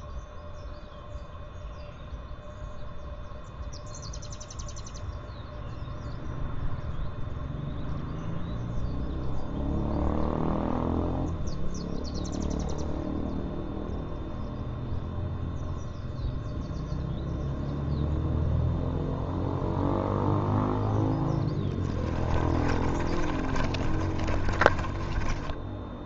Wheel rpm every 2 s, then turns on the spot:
0, 0, 0, 0, 0, 0, 0, 0, 0, 0, 0, 30, 30.
22-26